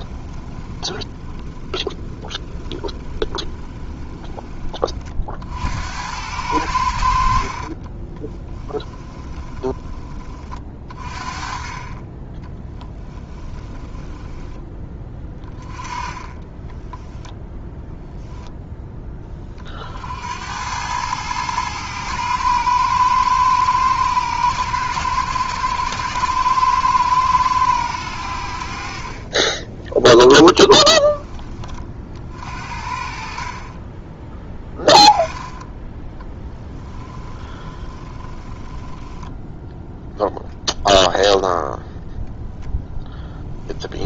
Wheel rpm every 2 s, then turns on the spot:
20, 20, 40, 70, 20, 40, 20, 20, 10, 10, 100, 110, 110, 110, 50, 20, 50, 10, 20, 10, 0, 0.
0-4 8-10 12-14 16-18 28-30 36-40